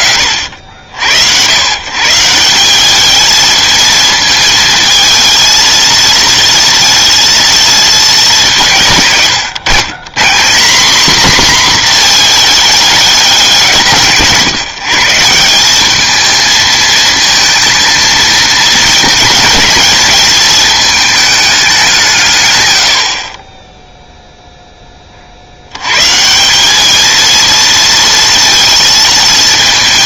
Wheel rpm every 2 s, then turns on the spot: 70, 190, 230, 230, 160, 190, 220, 170, 220, 220, 210, 100, 10, 200, 230.
none